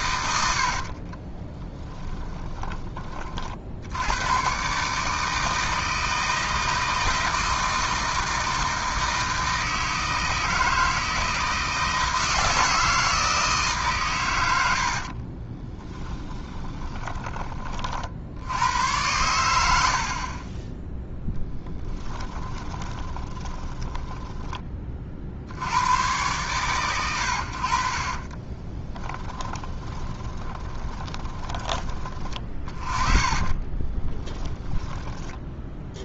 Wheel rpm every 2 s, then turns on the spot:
70, 20, 140, 160, 160, 160, 160, 70, 20, 90, 10, 20, 30, 110, 20, 20, 30, 10.
0-2 14-18 20-24 28-34